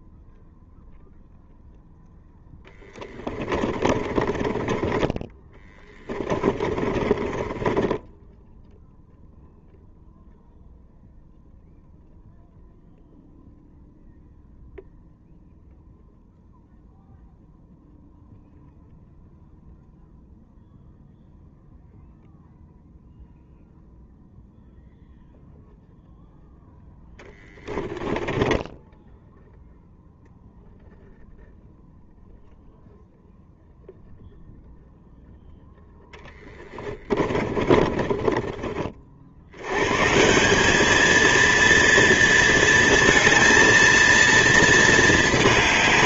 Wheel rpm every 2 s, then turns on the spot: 0, 10, 20, 20, 0, 0, 0, 0, 0, 0, 0, 0, 0, 10, 20, 0, 0, 0, 10, 30, 190, 230, 230.
4-8 28-30 36-40